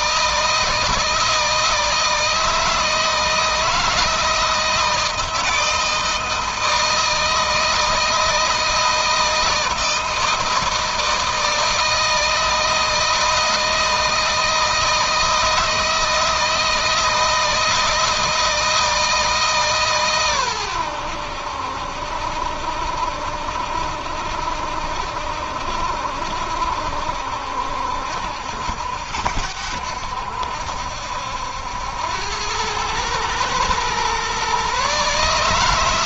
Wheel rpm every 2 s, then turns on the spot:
160, 160, 160, 160, 160, 160, 160, 160, 160, 160, 90, 70, 70, 70, 70, 70, 100, 140.
none